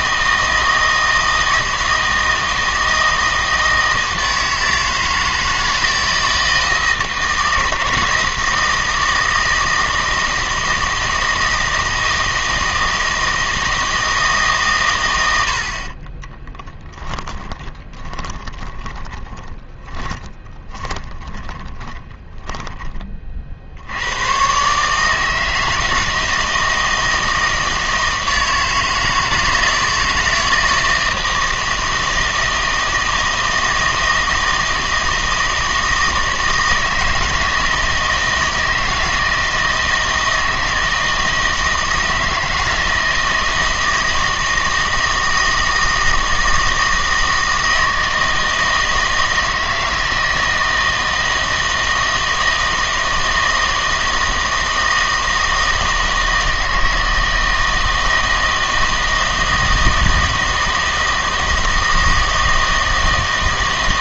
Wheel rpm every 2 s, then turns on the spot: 160, 160, 160, 160, 160, 160, 160, 130, 10, 20, 30, 20, 140, 160, 160, 160, 160, 160, 160, 160, 160, 160, 160, 160, 160, 160, 160, 160, 160, 160, 160, 160.
16-22